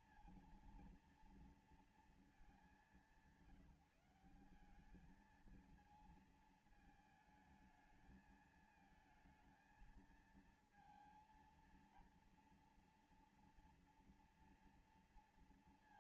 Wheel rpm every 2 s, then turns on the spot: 230, 200, 190, 220, 220, 230, 230, 230.
none